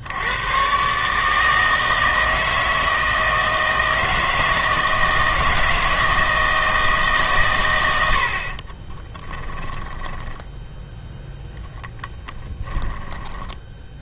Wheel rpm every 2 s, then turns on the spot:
130, 160, 160, 160, 20, 10, 20.
8-10 12-14